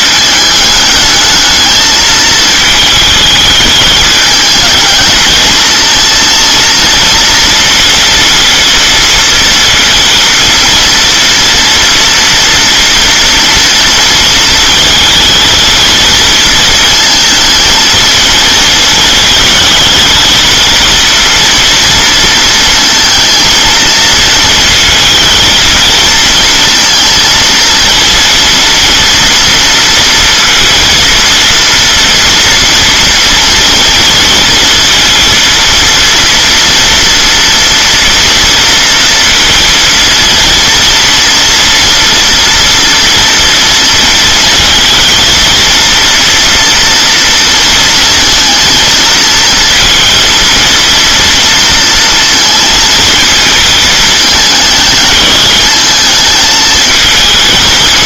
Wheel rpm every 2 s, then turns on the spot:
210, 220, 210, 230, 230, 230, 230, 230, 220, 230, 230, 230, 230, 230, 230, 230, 230, 230, 230, 230, 230, 240, 230, 230, 230, 230, 230, 220, 220.
none